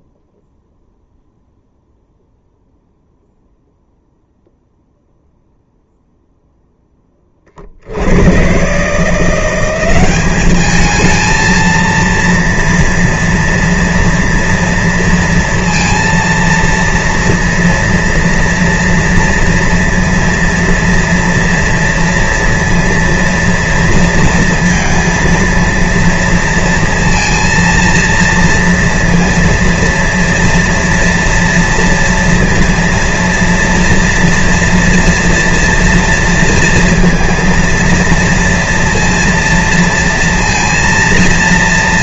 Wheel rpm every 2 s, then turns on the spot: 0, 0, 0, 10, 140, 210, 230, 230, 230, 230, 230, 230, 230, 230, 230, 230, 230, 240, 230, 230, 230.
none